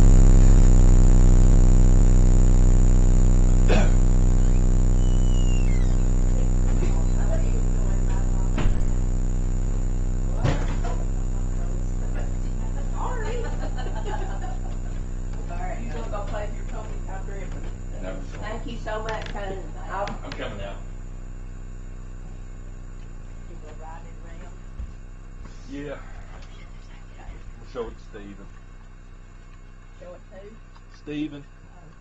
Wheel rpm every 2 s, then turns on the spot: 0, 0, 0, 0, 0, 0, 0, 0, 0, 0, 0, 0, 0, 0, 0, 0.
none